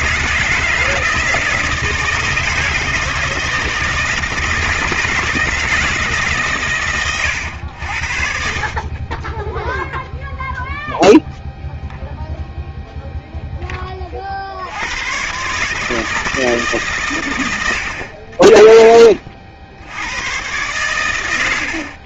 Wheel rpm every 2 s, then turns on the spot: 160, 160, 160, 120, 30, 0, 0, 90, 140, 40, 120.
none